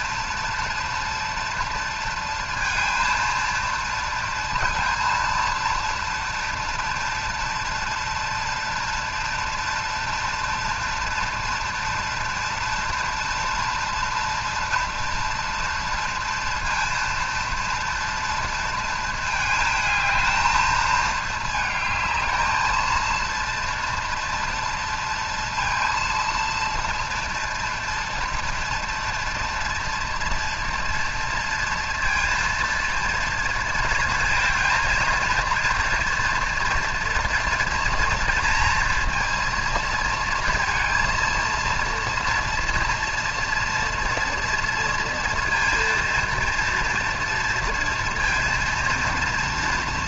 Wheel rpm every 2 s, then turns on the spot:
230, 230, 230, 240, 230, 230, 230, 230, 230, 220, 220, 220, 230, 240, 230, 230, 230, 230, 230, 230, 230, 230, 230, 230, 230.
none